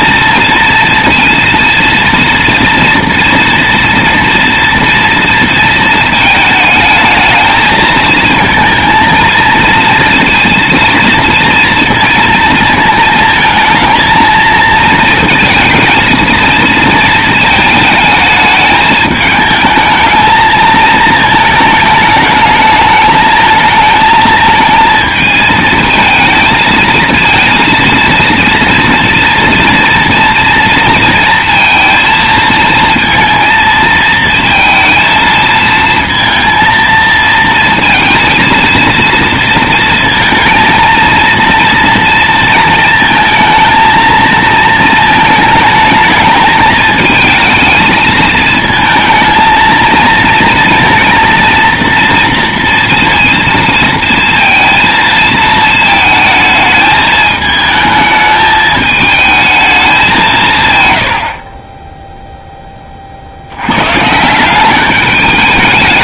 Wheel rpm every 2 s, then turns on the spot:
230, 230, 230, 220, 220, 230, 230, 220, 220, 210, 220, 210, 220, 220, 230, 230, 230, 230, 230, 230, 220, 230, 220, 220, 220, 230, 230, 230, 220, 210, 150, 10, 180.
none